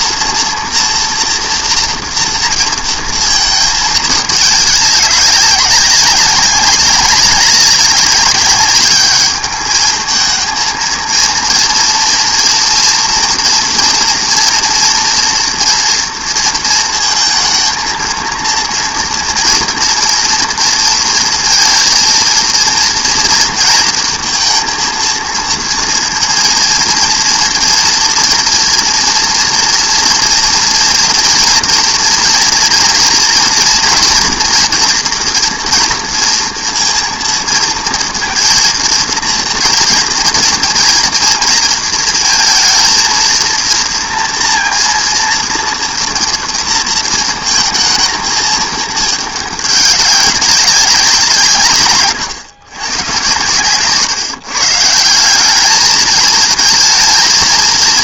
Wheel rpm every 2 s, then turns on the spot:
230, 240, 200, 190, 200, 220, 230, 230, 230, 230, 230, 230, 230, 230, 240, 230, 230, 230, 230, 230, 230, 230, 230, 230, 220, 190, 110, 150, 220.
none